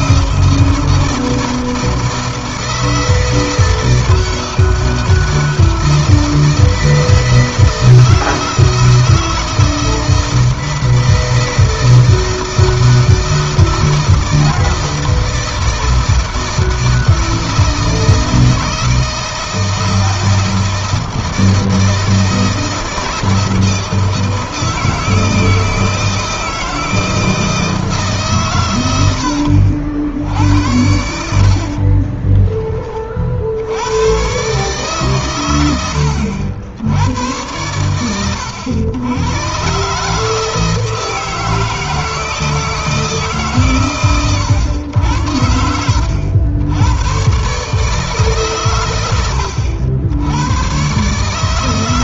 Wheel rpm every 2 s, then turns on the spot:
160, 160, 160, 160, 160, 160, 160, 160, 160, 160, 170, 160, 160, 160, 100, 70, 30, 130, 100, 100, 160, 160, 90, 110, 110, 130.
none